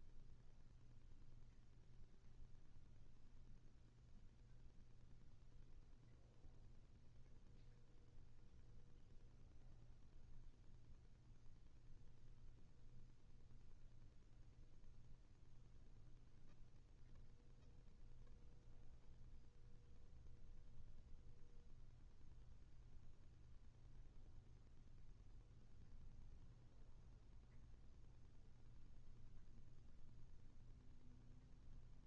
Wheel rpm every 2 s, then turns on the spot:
0, 0, 0, 0, 0, 0, 0, 0, 0, 0, 0, 0, 0, 0, 0, 0.
none